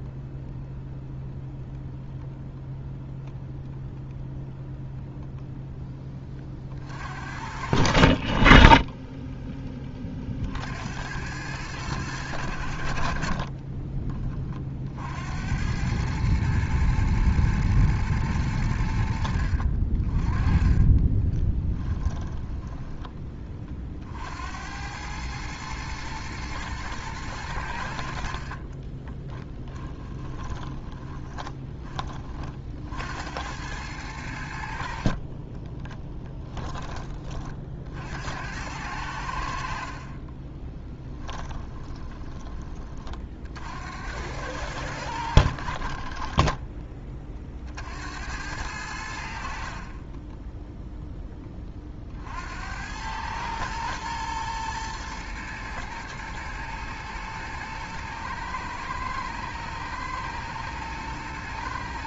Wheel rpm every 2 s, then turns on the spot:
0, 0, 0, 30, 40, 60, 70, 50, 110, 80, 30, 10, 80, 110, 50, 20, 40, 60, 20, 90, 20, 20, 100, 20, 90, 10, 80, 120, 110, 110, 110.
20-24 30-32 40-42 46-48